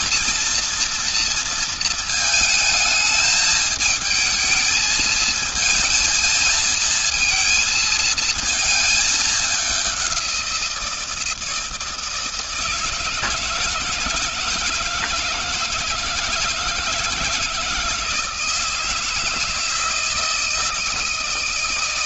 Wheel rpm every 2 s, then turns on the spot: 230, 220, 220, 230, 220, 180, 160, 160, 160, 160, 160.
none